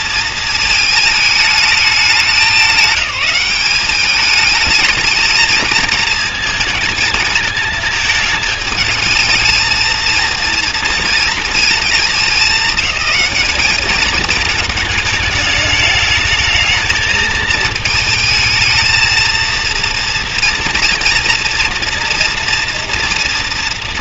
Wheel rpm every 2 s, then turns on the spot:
220, 190, 210, 220, 220, 230, 210, 220, 220, 220, 230, 240.
none